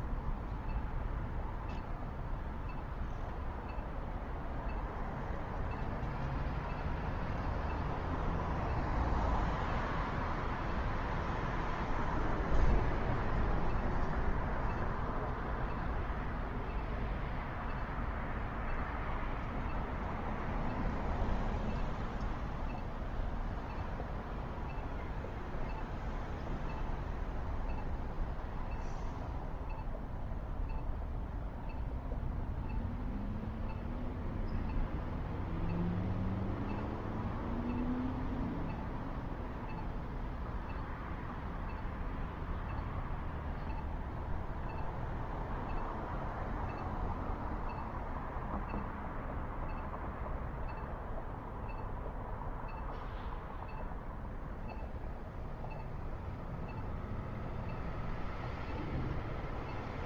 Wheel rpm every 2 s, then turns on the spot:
0, 0, 0, 0, 0, 0, 0, 0, 0, 0, 0, 0, 0, 0, 0, 0, 0, 0, 0, 0, 0, 0, 0, 0, 0, 0, 0, 0, 0, 0.
none